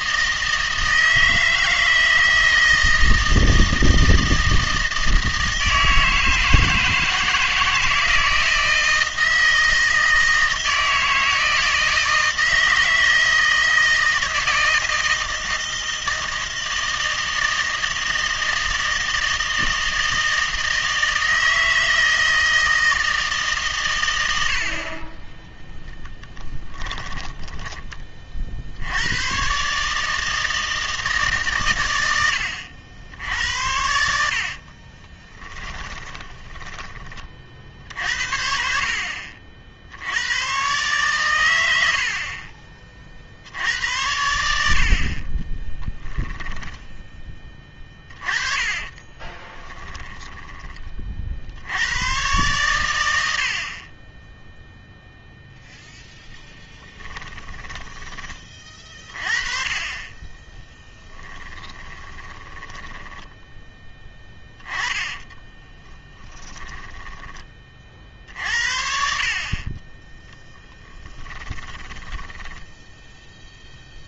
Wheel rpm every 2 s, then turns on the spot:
160, 160, 160, 160, 160, 160, 160, 160, 160, 160, 160, 160, 70, 10, 60, 160, 80, 50, 30, 60, 120, 40, 80, 10, 30, 20, 110, 0, 10, 30, 10, 20, 10, 10, 50, 10, 10.
26-28 34-38 48-50 56-58 60-68 70-74